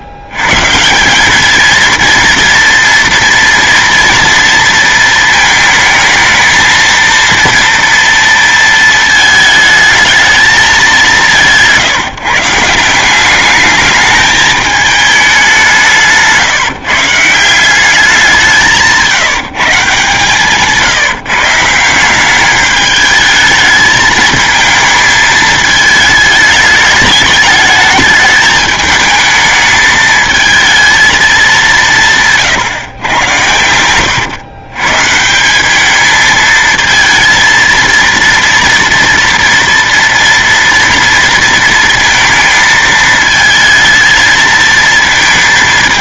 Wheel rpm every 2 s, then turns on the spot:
110, 230, 230, 220, 220, 220, 170, 220, 160, 190, 150, 200, 220, 210, 210, 220, 130, 120, 220, 230, 230, 220, 220.
20-22